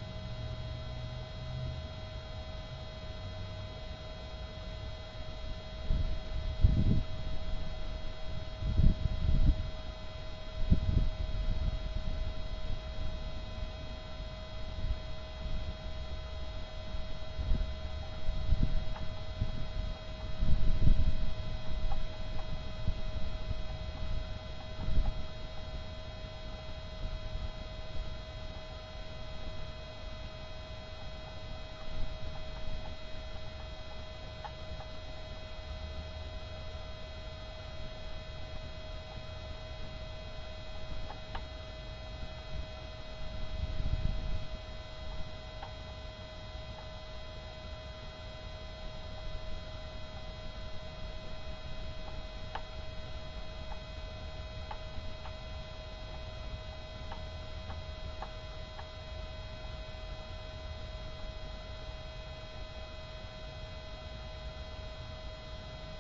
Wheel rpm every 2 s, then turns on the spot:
0, 0, 0, 0, 0, 0, 0, 0, 0, 0, 0, 0, 0, 0, 0, 0, 0, 0, 0, 0, 0, 0, 0, 0, 0, 0, 0, 0, 0, 0, 0, 0, 0.
none